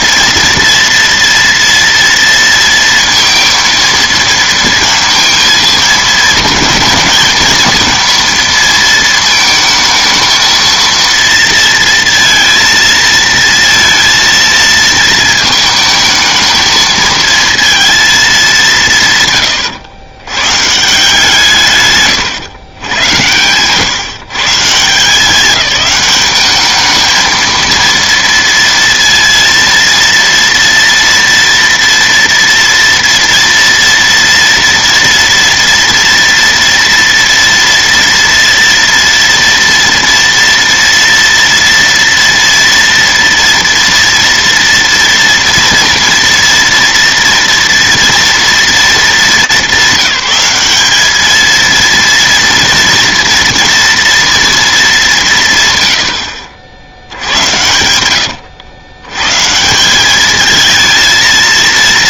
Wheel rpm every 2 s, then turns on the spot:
230, 230, 230, 220, 230, 230, 230, 230, 220, 150, 150, 110, 170, 210, 230, 230, 230, 230, 230, 240, 230, 230, 230, 230, 220, 200, 230, 210, 60, 90, 220.
none